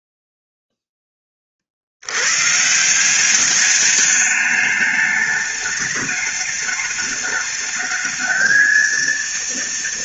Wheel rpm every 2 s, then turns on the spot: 0, 130, 210, 210, 220.
none